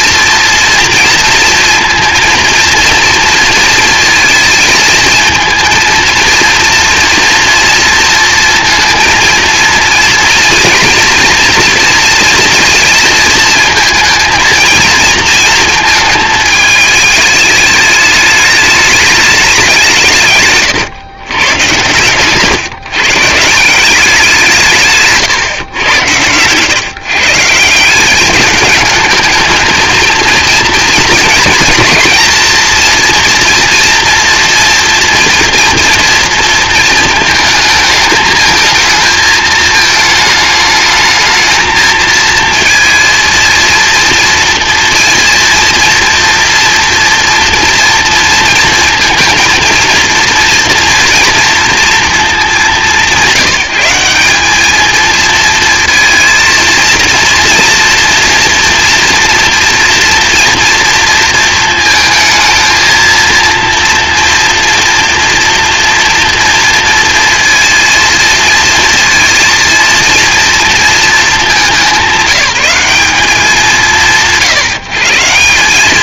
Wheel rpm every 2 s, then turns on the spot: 230, 230, 230, 230, 230, 230, 230, 230, 210, 210, 120, 150, 140, 150, 220, 220, 230, 230, 220, 220, 220, 230, 230, 230, 230, 230, 190, 220, 230, 230, 230, 230, 240, 230, 230, 220, 170, 160.
24-26